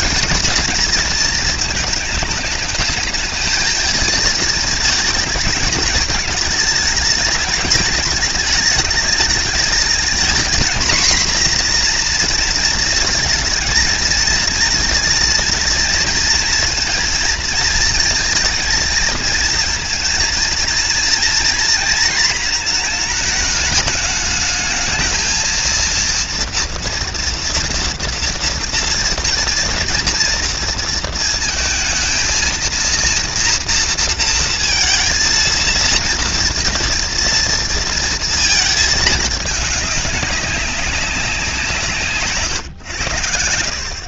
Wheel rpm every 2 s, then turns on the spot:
230, 220, 220, 210, 220, 240, 230, 230, 230, 220, 230, 230, 220, 230, 230, 230, 230, 230, 230, 220, 190, 110.
none